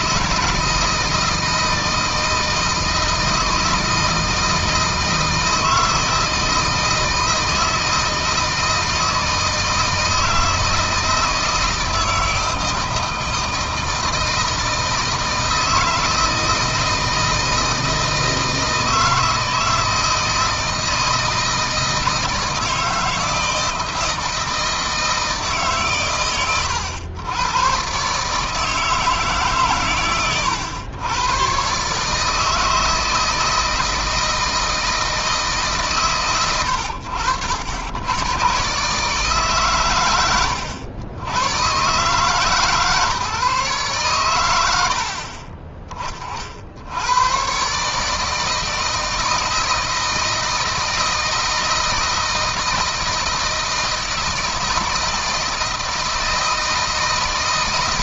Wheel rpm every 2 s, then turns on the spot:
160, 160, 160, 160, 160, 160, 160, 160, 160, 160, 160, 160, 160, 110, 160, 110, 160, 160, 100, 140, 90, 150, 70, 100, 160, 160, 160, 160, 160.
none